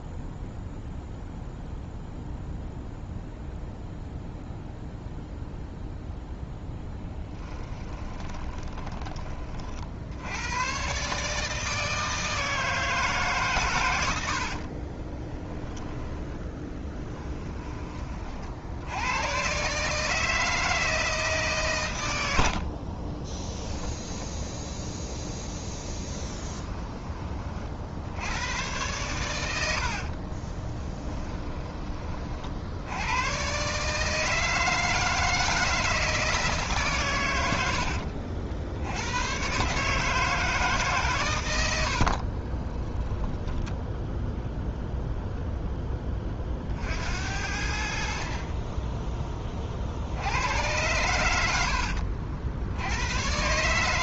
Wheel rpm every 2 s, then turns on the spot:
0, 0, 0, 0, 20, 120, 160, 40, 20, 70, 160, 50, 0, 10, 110, 20, 80, 160, 140, 70, 150, 10, 0, 50, 20, 100, 80.
8-10 14-18 22-24 30-32 42-44